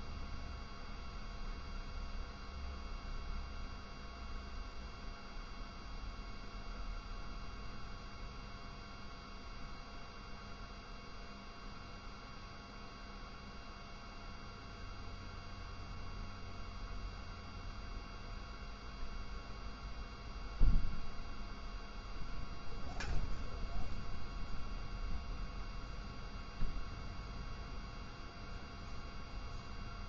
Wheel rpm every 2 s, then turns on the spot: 0, 0, 0, 0, 0, 0, 0, 0, 0, 0, 0, 0, 0, 0, 0.
none